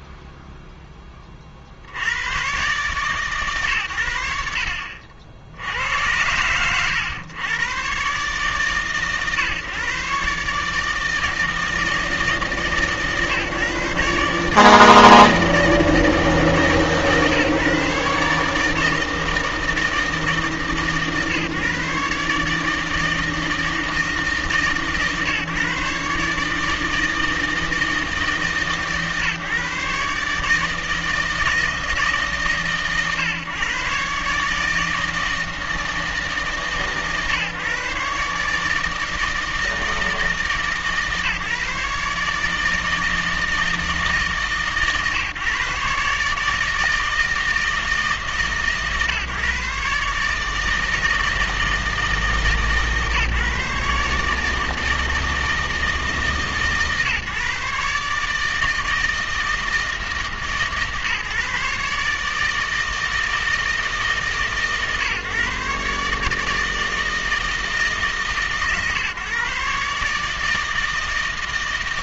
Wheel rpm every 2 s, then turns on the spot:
0, 130, 80, 100, 130, 150, 160, 150, 150, 150, 150, 150, 140, 150, 150, 160, 140, 150, 150, 150, 150, 150, 150, 160, 140, 160, 150, 160, 140, 160, 150, 160, 140, 160, 140, 160.
none